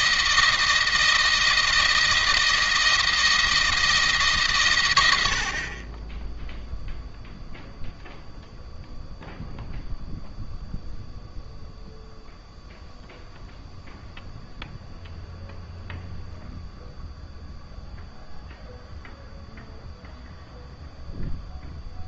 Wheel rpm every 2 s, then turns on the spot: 160, 160, 110, 0, 0, 0, 0, 0, 0, 0, 0.
none